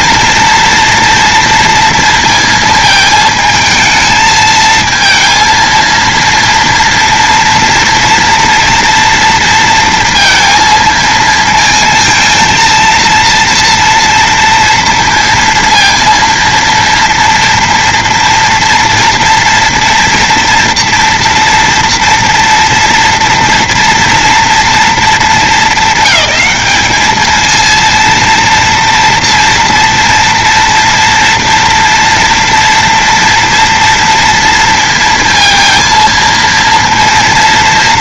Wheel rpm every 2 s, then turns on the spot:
230, 220, 220, 230, 230, 230, 230, 230, 230, 230, 230, 230, 230, 210, 230, 230, 230, 230, 230.
none